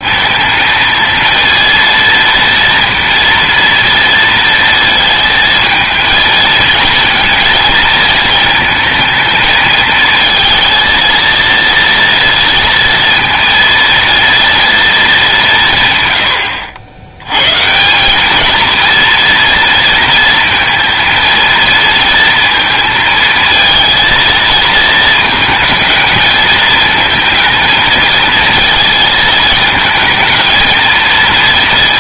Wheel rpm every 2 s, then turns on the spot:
220, 230, 230, 220, 220, 230, 230, 220, 70, 230, 230, 230, 220, 220, 230, 230.
none